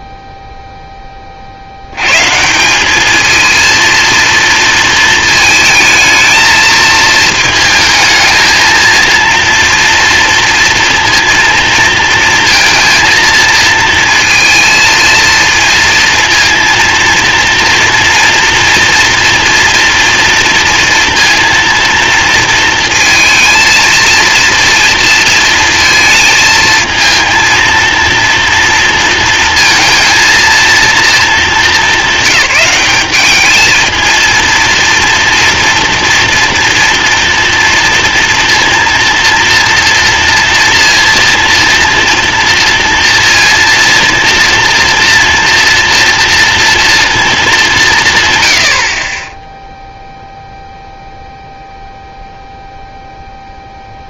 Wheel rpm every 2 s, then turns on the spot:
0, 170, 230, 220, 220, 230, 230, 230, 230, 230, 230, 230, 230, 220, 230, 230, 190, 230, 230, 230, 230, 230, 230, 230, 100, 0, 0.
none